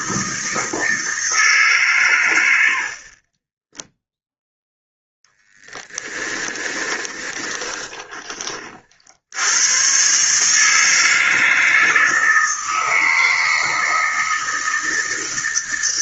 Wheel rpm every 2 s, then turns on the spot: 160, 60, 0, 20, 50, 160, 160, 160.
6-8